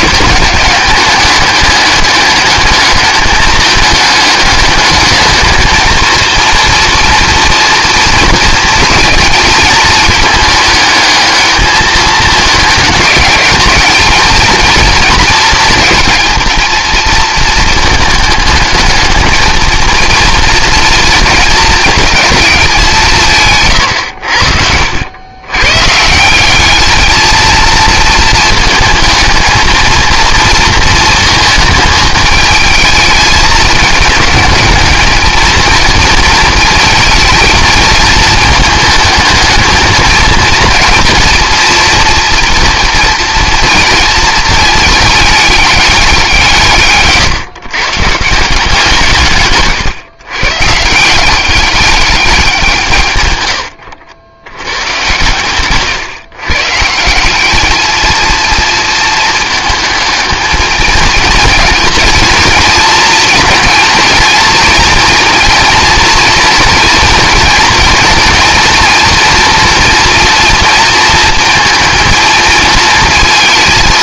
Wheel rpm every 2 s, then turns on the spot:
210, 210, 210, 230, 220, 220, 210, 220, 220, 220, 230, 200, 80, 200, 220, 230, 220, 210, 230, 220, 230, 230, 220, 160, 170, 140, 170, 100, 140, 230, 220, 230, 230, 230, 230, 230, 220.
none